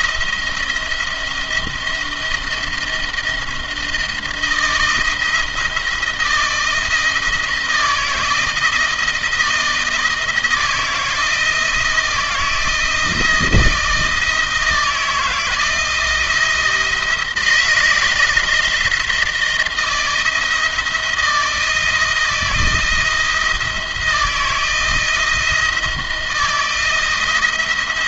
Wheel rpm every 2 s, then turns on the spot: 170, 170, 160, 160, 170, 160, 160, 160, 160, 170, 160, 170, 160, 170.
none